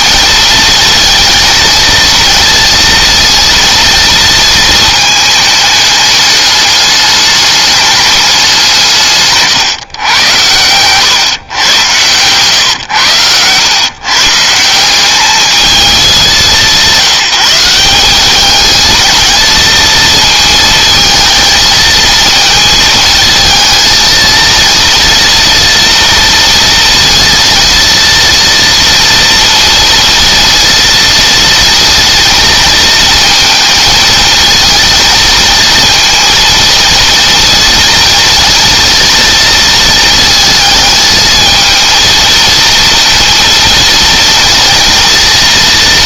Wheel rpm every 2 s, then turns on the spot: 230, 230, 220, 210, 170, 120, 120, 170, 190, 210, 230, 220, 230, 230, 230, 230, 230, 230, 230, 230, 220, 230, 230.
12-14